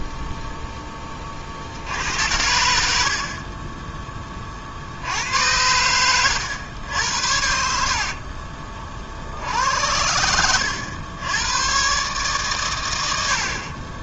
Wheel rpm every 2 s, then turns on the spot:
10, 60, 70, 100, 50, 90, 100.
none